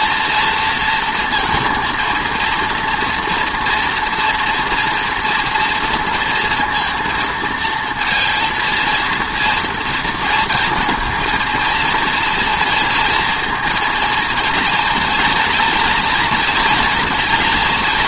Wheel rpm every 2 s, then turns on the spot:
230, 230, 230, 230, 230, 220, 230, 240, 230.
none